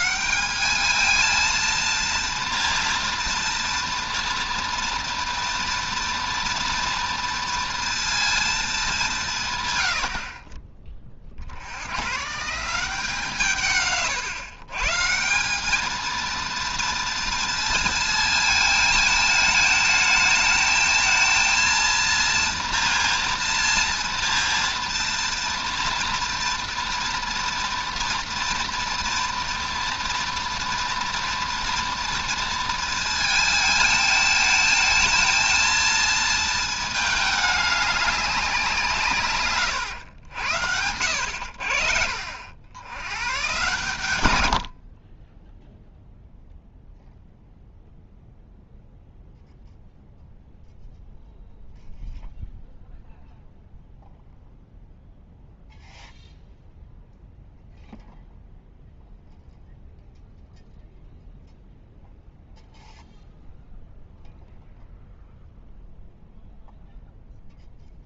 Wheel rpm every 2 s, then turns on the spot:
210, 230, 230, 230, 210, 30, 170, 130, 230, 220, 220, 230, 230, 240, 230, 230, 230, 220, 220, 170, 90, 90, 60, 0, 0, 0, 0, 0, 0, 0, 0, 0, 0, 0.
40-42